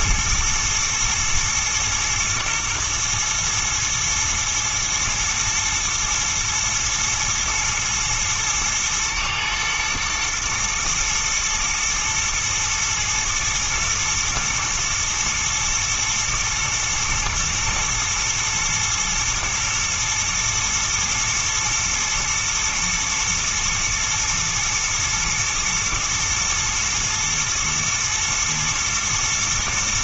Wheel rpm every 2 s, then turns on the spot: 110, 120, 110, 110, 110, 110, 110, 110, 120, 110, 110, 110, 120, 120, 110.
none